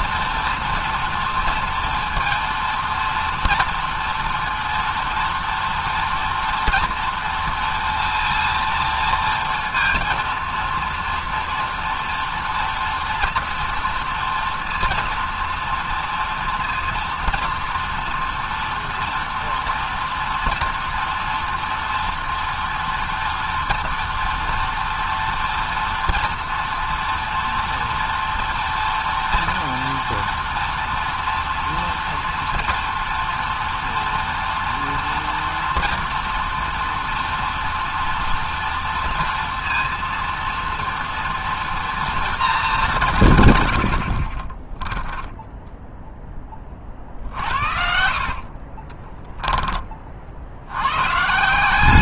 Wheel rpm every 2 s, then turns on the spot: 230, 240, 230, 230, 230, 230, 240, 240, 230, 240, 230, 230, 230, 230, 240, 230, 230, 230, 230, 230, 230, 130, 10, 50, 10, 160.
46-50